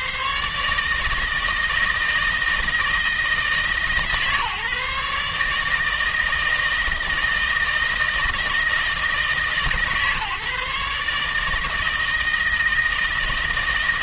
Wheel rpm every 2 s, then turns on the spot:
160, 160, 140, 160, 160, 150, 160.
none